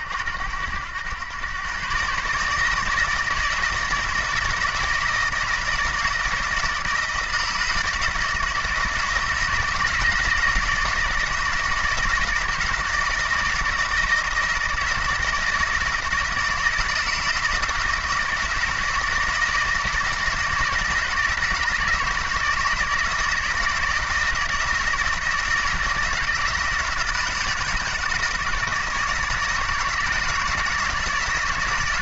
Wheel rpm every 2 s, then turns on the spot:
90, 150, 160, 160, 160, 160, 160, 160, 160, 160, 160, 160, 160, 160, 160, 160.
none